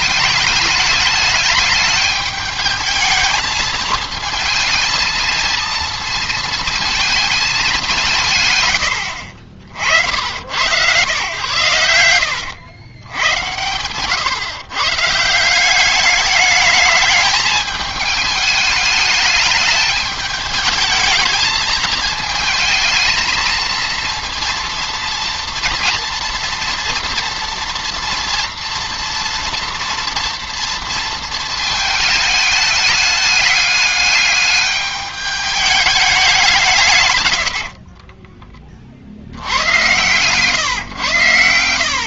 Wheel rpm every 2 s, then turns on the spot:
210, 210, 220, 230, 100, 110, 100, 130, 210, 210, 210, 220, 230, 230, 230, 230, 210, 210, 170, 20, 130.
8-10